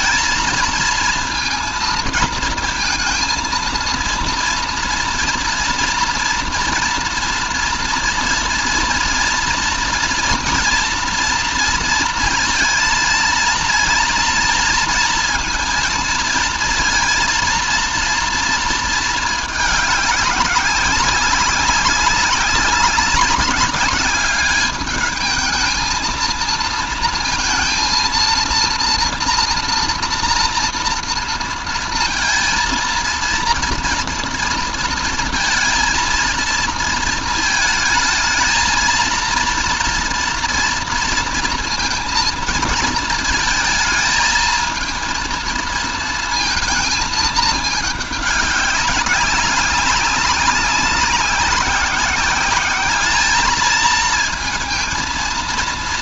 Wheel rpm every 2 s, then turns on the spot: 230, 230, 230, 240, 230, 240, 230, 230, 230, 230, 200, 190, 210, 230, 230, 240, 230, 230, 230, 230, 230, 230, 230, 230, 200, 200, 200, 230.
none